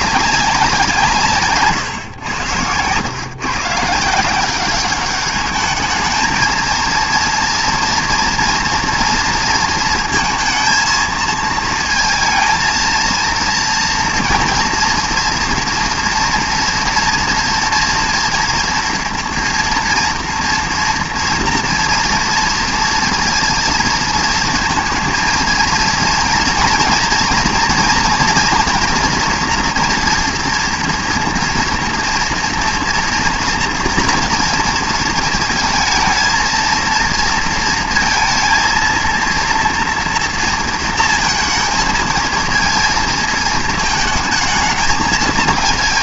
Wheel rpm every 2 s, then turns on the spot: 180, 110, 190, 230, 230, 220, 230, 230, 230, 230, 230, 230, 230, 230, 240, 240, 230, 230, 230, 230, 230, 220, 220.
none